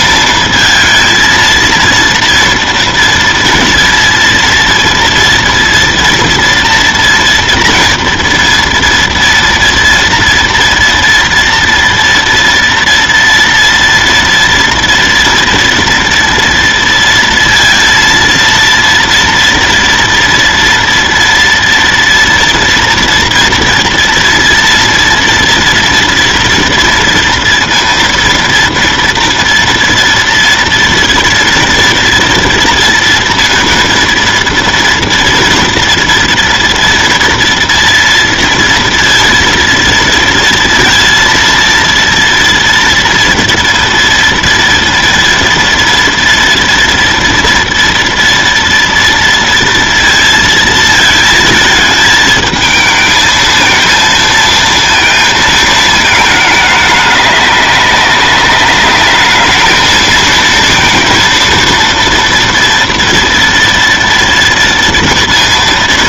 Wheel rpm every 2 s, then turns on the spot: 230, 230, 230, 230, 230, 230, 230, 230, 230, 230, 230, 230, 230, 230, 230, 230, 240, 230, 230, 230, 230, 240, 230, 230, 230, 230, 220, 230, 210, 200, 230, 230, 230.
none